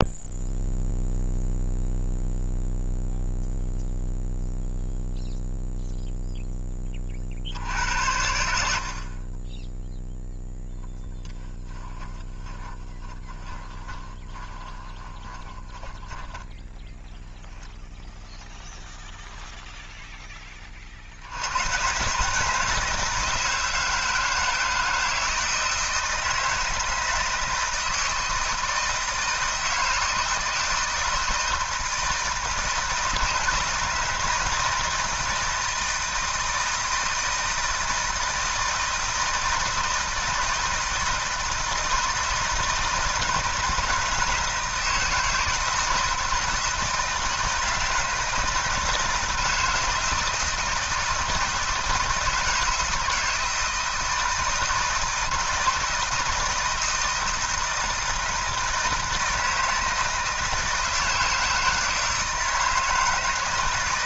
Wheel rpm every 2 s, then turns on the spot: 0, 0, 0, 10, 70, 0, 20, 20, 10, 0, 30, 150, 160, 160, 160, 160, 160, 160, 160, 160, 160, 160, 160, 160, 160, 160, 160, 160, 170, 160, 160, 160.
12-18